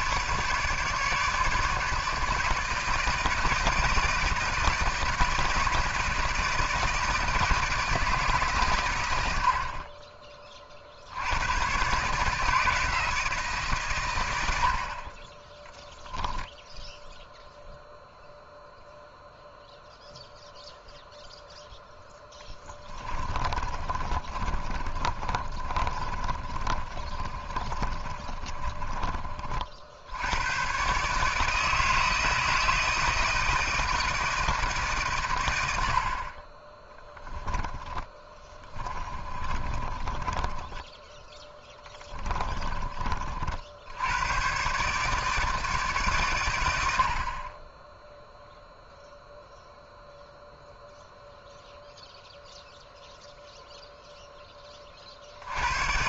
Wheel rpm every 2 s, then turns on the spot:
150, 160, 160, 160, 130, 50, 160, 90, 0, 0, 0, 20, 40, 40, 30, 120, 160, 160, 30, 20, 20, 20, 140, 90, 0, 0, 0, 20.
22-30 38-42